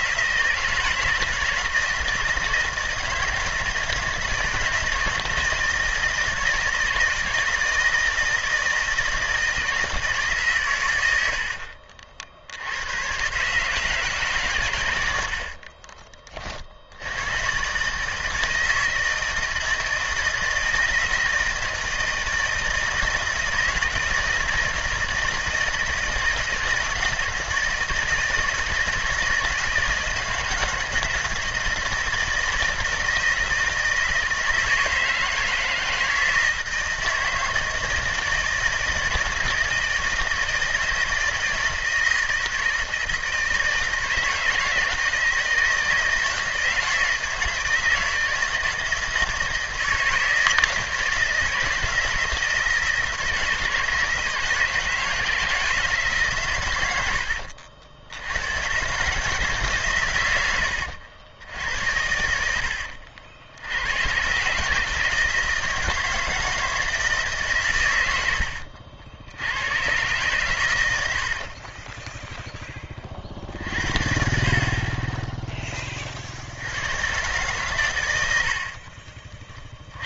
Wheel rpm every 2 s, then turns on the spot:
160, 160, 160, 160, 160, 130, 80, 120, 40, 160, 160, 160, 160, 160, 160, 160, 160, 160, 160, 160, 160, 160, 160, 160, 160, 160, 160, 160, 110, 120, 100, 80, 140, 160, 70, 110, 10, 40, 90, 50.
68-70 78-80